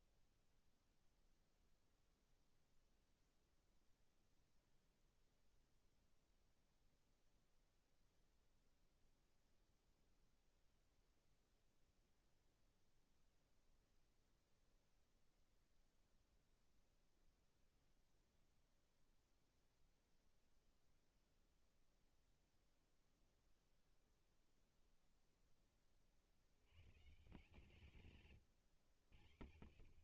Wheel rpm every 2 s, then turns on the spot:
0, 0, 0, 0, 0, 0, 0, 0, 0, 0, 0, 0, 0, 130, 100.
none